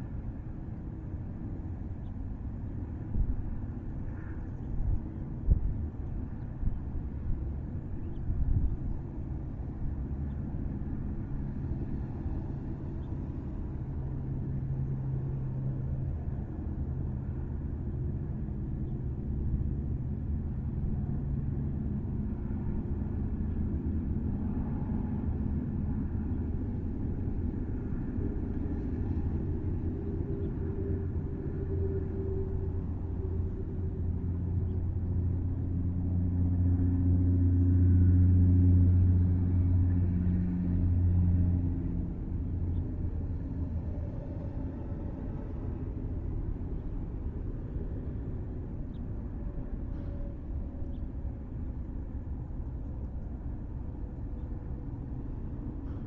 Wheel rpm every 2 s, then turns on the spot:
0, 0, 0, 0, 0, 0, 0, 0, 0, 0, 0, 0, 0, 0, 0, 0, 0, 0, 0, 0, 0, 0, 0, 0, 0, 0, 0, 0.
none